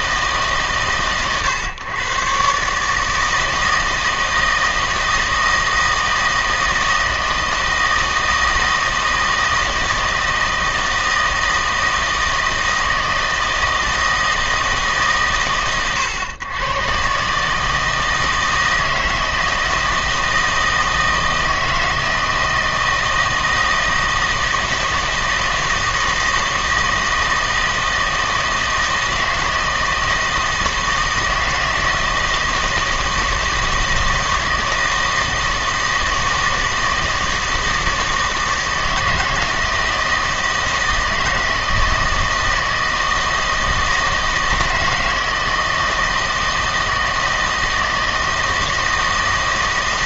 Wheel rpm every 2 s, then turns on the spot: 140, 140, 160, 160, 160, 160, 160, 150, 120, 160, 160, 160, 160, 160, 160, 160, 160, 160, 160, 160, 160, 160, 160, 160, 160.
none